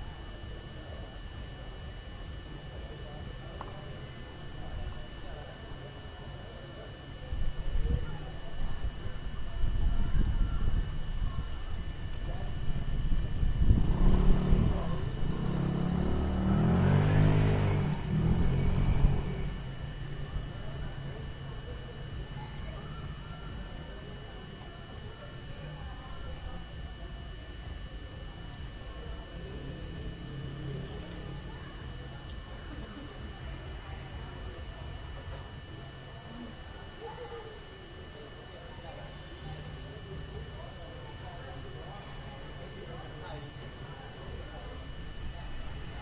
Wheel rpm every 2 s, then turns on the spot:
0, 0, 0, 0, 0, 0, 0, 0, 0, 0, 0, 0, 0, 0, 0, 0, 0, 0, 0, 0, 0, 0, 0.
none